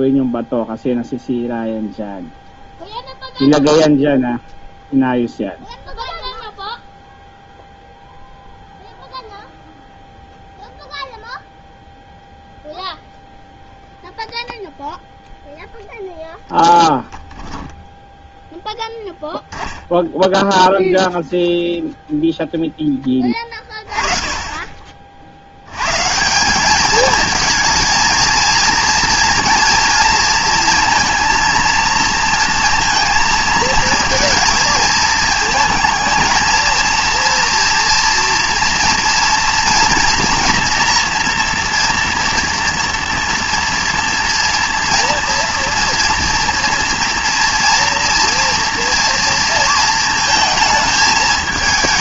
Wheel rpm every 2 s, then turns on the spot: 0, 0, 0, 0, 0, 0, 0, 0, 0, 0, 0, 10, 30, 200, 230, 230, 230, 230, 230, 230, 230, 230, 240, 230, 230, 220.
none